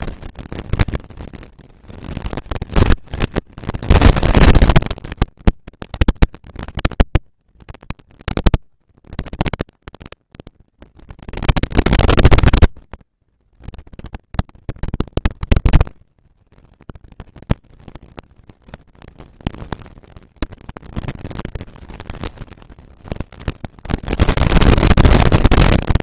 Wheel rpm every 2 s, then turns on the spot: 230, 230, 230, 240, 240, 240, 230, 230, 230, 230, 230, 220, 200.
none